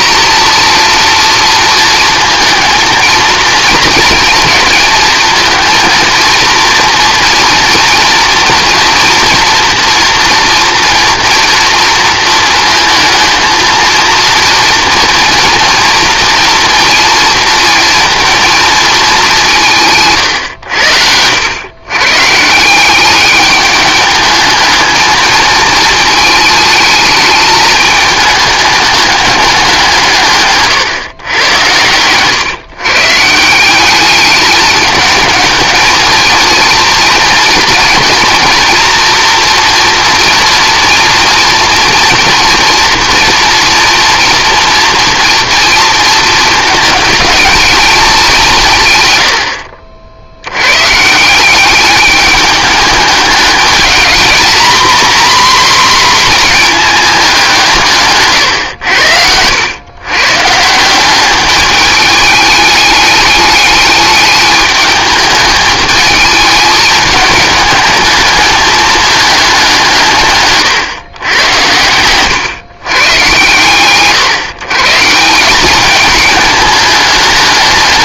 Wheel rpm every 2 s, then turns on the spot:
230, 220, 230, 230, 230, 230, 230, 230, 230, 230, 110, 160, 210, 220, 210, 140, 130, 210, 230, 240, 240, 240, 230, 220, 170, 90, 210, 240, 230, 110, 160, 210, 210, 220, 210, 130, 130, 140, 210.
30-32 58-60